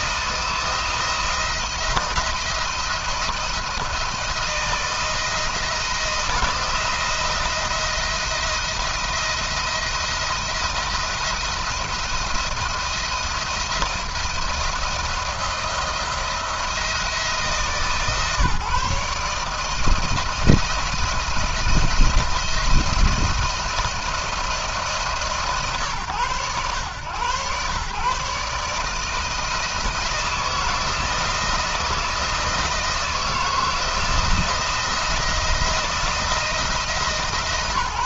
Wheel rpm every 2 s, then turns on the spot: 170, 170, 170, 170, 170, 170, 170, 170, 160, 160, 170, 170, 160, 120, 150, 160, 160, 170, 160.
none